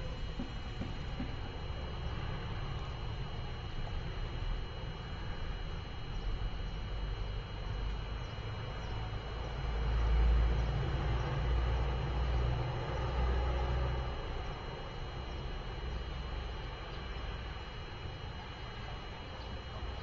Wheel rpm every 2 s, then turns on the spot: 0, 0, 0, 0, 0, 0, 0, 0, 0, 0.
none